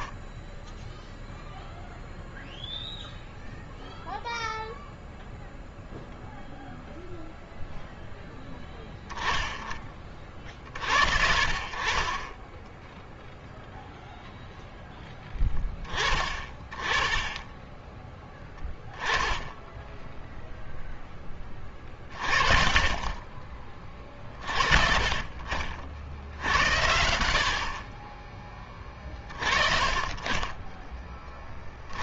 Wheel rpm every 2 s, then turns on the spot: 10, 0, 0, 0, 10, 50, 20, 0, 20, 10, 0, 30, 40, 70, 20, 20.
12-14